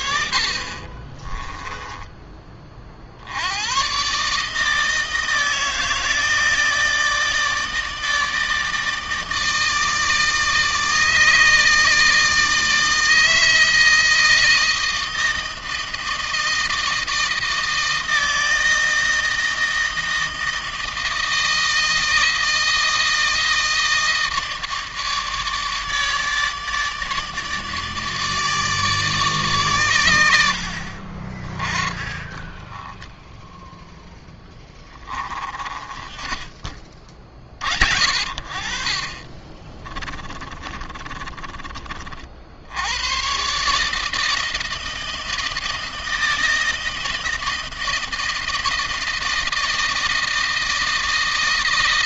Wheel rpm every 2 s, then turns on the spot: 40, 30, 150, 160, 160, 160, 160, 160, 160, 160, 160, 160, 160, 150, 150, 70, 10, 20, 30, 40, 20, 70, 160, 160, 160, 160.
0-2 32-36 40-42